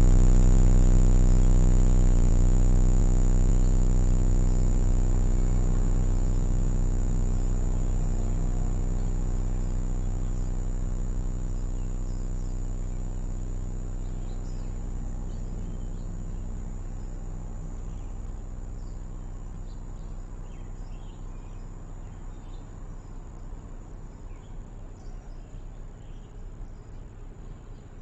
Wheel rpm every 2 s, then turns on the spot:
0, 0, 0, 0, 0, 0, 0, 0, 0, 0, 0, 0, 0, 0.
none